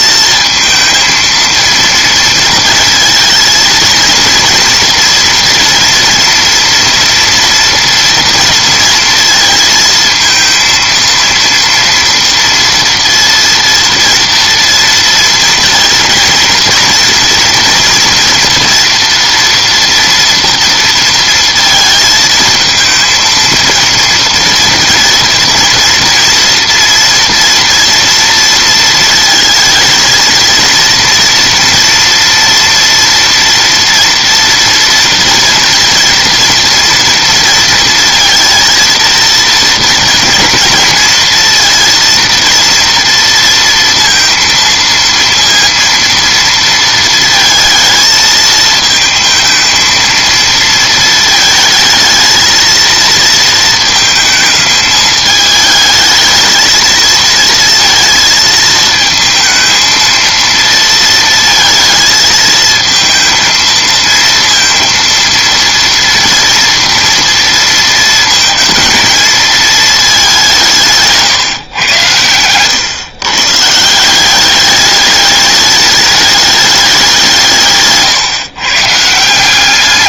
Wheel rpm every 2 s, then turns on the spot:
220, 220, 230, 240, 230, 230, 230, 230, 230, 230, 230, 220, 230, 230, 230, 230, 230, 230, 230, 230, 230, 230, 230, 230, 220, 220, 230, 220, 220, 220, 230, 220, 230, 230, 230, 160, 110, 200, 200, 140.
none